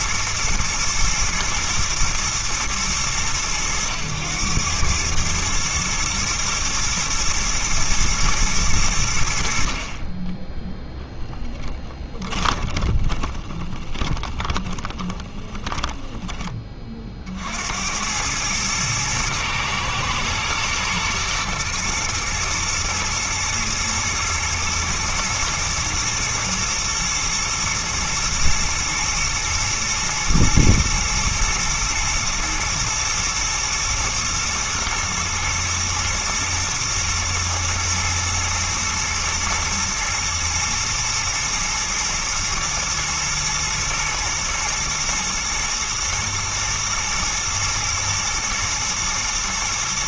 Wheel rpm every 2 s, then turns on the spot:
110, 110, 100, 120, 110, 10, 20, 20, 20, 110, 120, 110, 110, 110, 110, 110, 110, 120, 110, 120, 110, 110, 110, 110, 110.
12-16